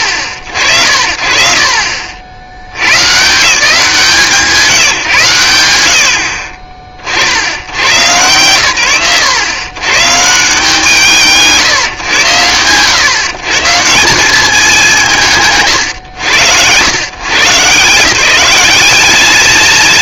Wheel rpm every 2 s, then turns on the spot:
70, 80, 160, 40, 90, 160, 100, 170, 130, 210.
none